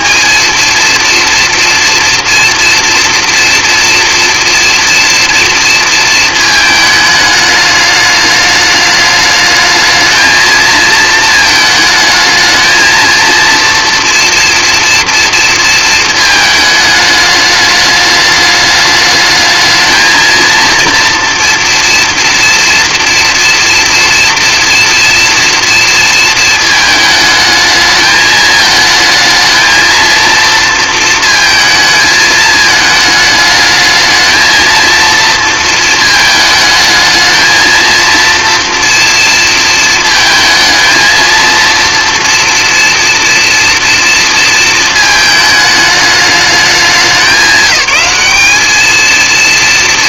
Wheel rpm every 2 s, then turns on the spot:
230, 230, 230, 220, 210, 220, 220, 230, 210, 210, 230, 230, 230, 220, 220, 230, 220, 230, 220, 230, 220, 240, 220, 200, 220.
none